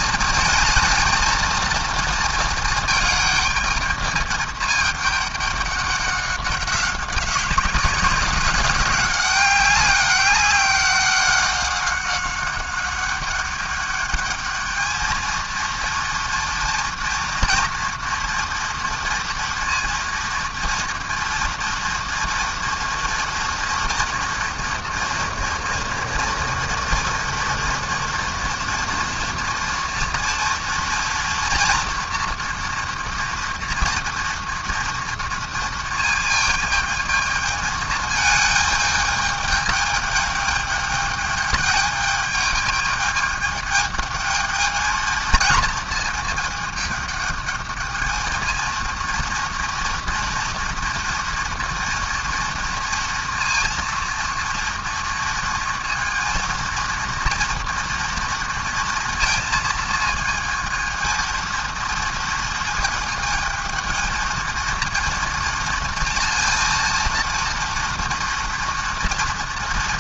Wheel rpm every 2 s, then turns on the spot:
230, 220, 210, 190, 190, 190, 200, 220, 240, 230, 230, 230, 230, 230, 230, 230, 230, 230, 220, 220, 210, 210, 220, 210, 230, 230, 230, 230, 230, 230, 220, 220, 230, 230, 230.
none